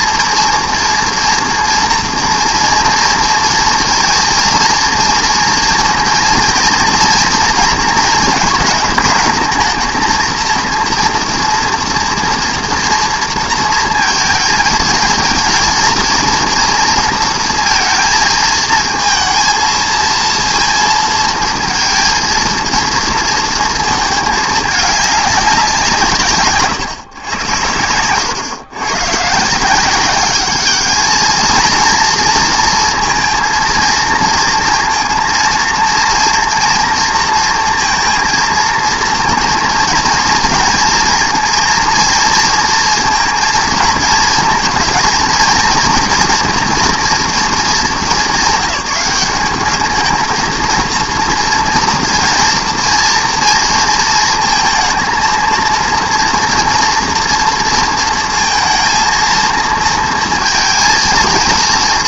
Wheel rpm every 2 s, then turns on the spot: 230, 230, 230, 230, 220, 230, 230, 220, 240, 230, 230, 230, 210, 110, 120, 210, 230, 230, 230, 230, 230, 230, 230, 230, 200, 230, 240, 230, 230, 230, 230.
none